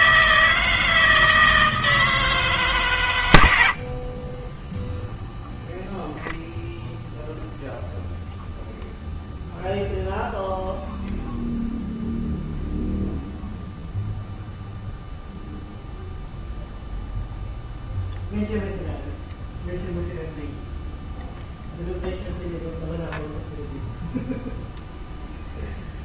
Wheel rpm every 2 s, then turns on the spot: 160, 160, 90, 0, 0, 0, 0, 0, 0, 0, 0, 0, 0.
none